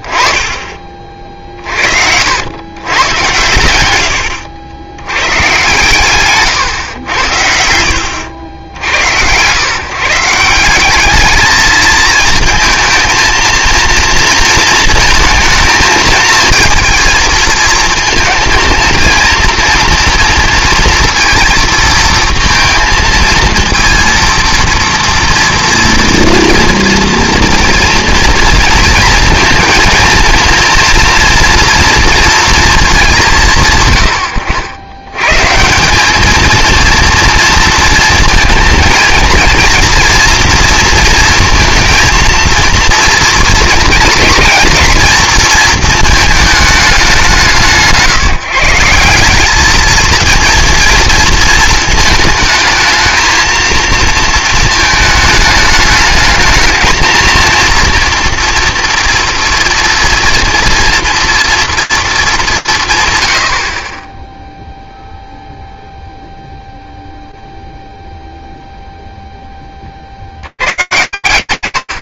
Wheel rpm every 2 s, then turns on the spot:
50, 100, 120, 80, 100, 210, 220, 220, 220, 230, 230, 230, 230, 230, 230, 240, 200, 120, 230, 230, 230, 220, 220, 190, 180, 230, 220, 220, 220, 230, 230, 120, 0, 0, 0, 150.
none